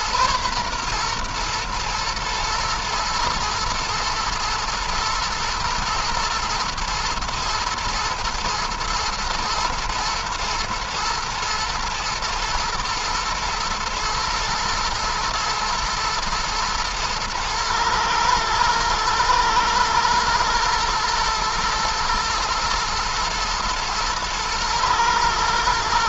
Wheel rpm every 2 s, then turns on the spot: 120, 110, 120, 110, 120, 110, 110, 120, 120, 110, 120, 110, 110.
none